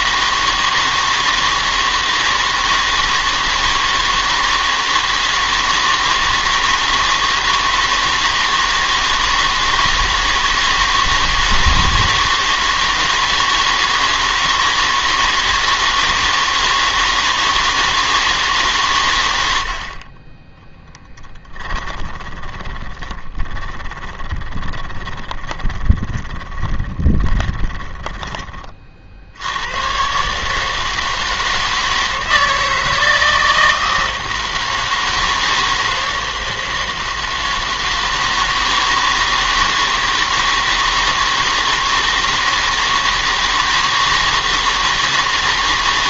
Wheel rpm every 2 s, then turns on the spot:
160, 160, 160, 160, 160, 160, 160, 160, 160, 150, 10, 20, 30, 30, 30, 160, 160, 160, 160, 160, 160, 160, 160.
22-28